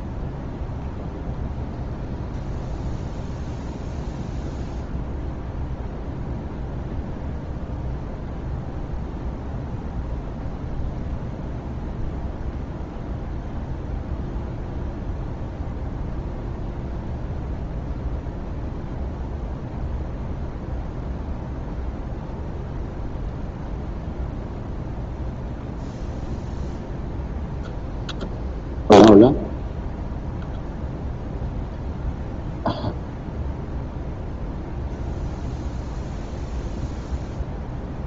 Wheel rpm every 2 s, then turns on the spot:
0, 0, 0, 0, 0, 0, 0, 0, 0, 0, 0, 0, 0, 0, 0, 0, 0, 0, 0.
none